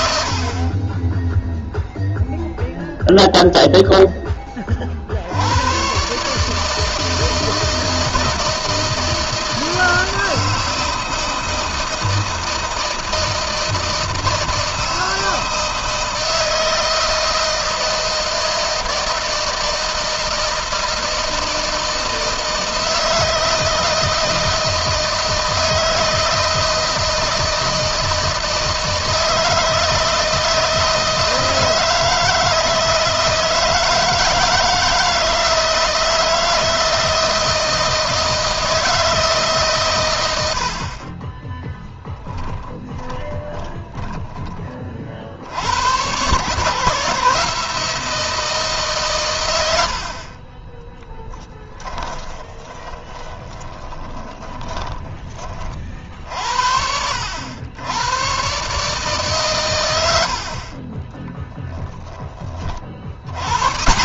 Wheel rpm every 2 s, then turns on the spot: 20, 0, 50, 160, 160, 160, 160, 160, 160, 160, 160, 160, 160, 160, 160, 160, 160, 160, 160, 160, 50, 20, 50, 150, 140, 20, 30, 20, 70, 150, 30, 60.
40-44 50-54 60-62